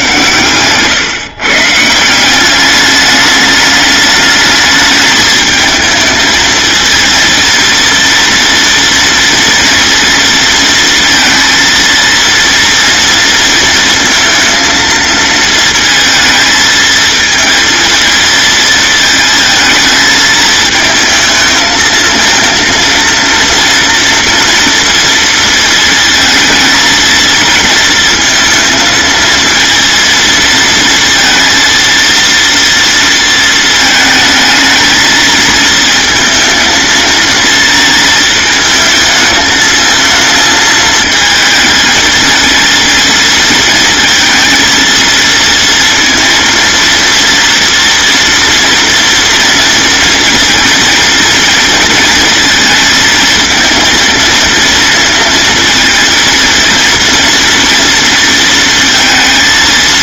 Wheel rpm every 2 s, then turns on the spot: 130, 200, 210, 220, 230, 230, 230, 230, 220, 220, 220, 230, 230, 230, 230, 230, 230, 220, 230, 220, 220, 230, 230, 230, 230, 230, 230, 230, 230, 230.
none